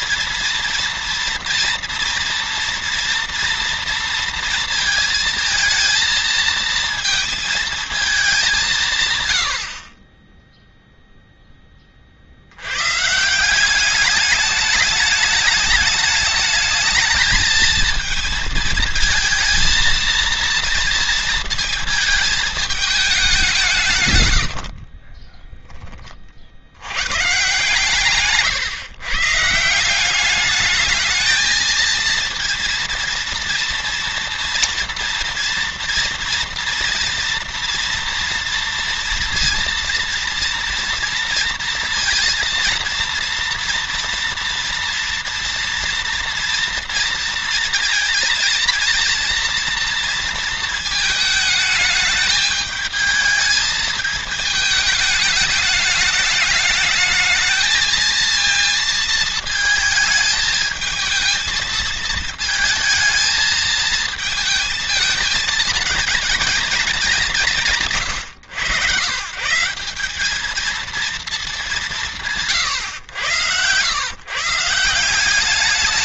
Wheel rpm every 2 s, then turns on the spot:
230, 230, 230, 230, 200, 20, 80, 210, 210, 220, 230, 220, 90, 50, 130, 200, 230, 230, 230, 240, 230, 230, 230, 230, 230, 230, 220, 220, 210, 230, 220, 230, 220, 220, 110, 210, 160, 140.
24-26